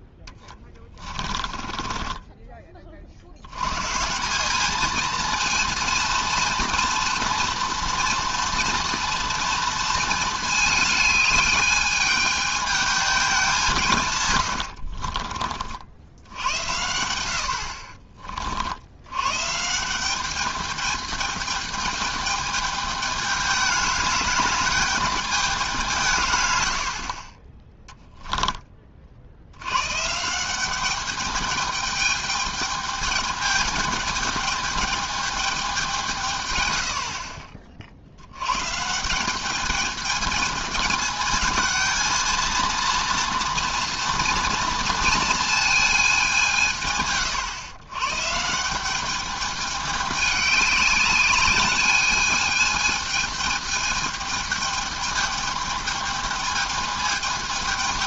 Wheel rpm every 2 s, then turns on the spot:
20, 30, 200, 230, 240, 220, 220, 90, 80, 50, 210, 210, 200, 100, 10, 180, 210, 210, 110, 120, 210, 230, 240, 170, 160, 210, 220, 220, 220.
0-2 14-16